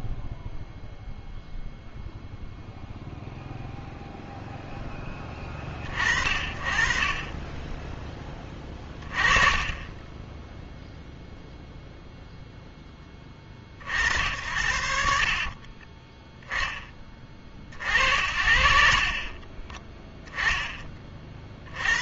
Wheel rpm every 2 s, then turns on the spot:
0, 0, 0, 30, 20, 10, 0, 80, 10, 60, 0.
none